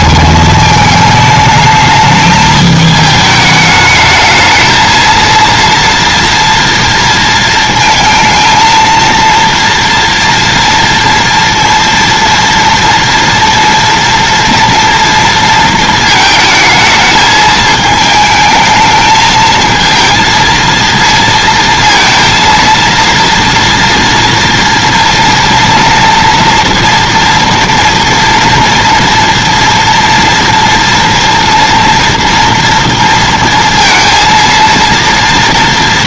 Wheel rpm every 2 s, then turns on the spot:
220, 220, 220, 230, 220, 230, 230, 230, 220, 220, 230, 230, 240, 240, 230, 230, 230, 230.
none